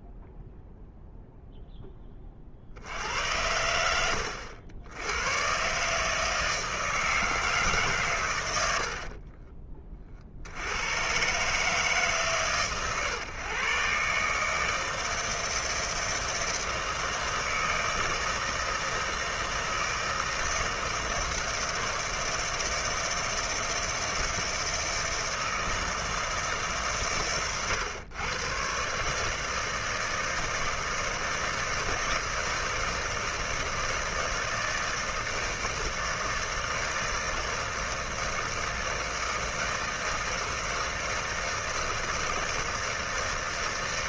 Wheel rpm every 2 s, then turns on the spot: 0, 40, 80, 160, 90, 60, 140, 150, 160, 160, 160, 160, 160, 150, 120, 160, 160, 160, 160, 160, 160, 160.
none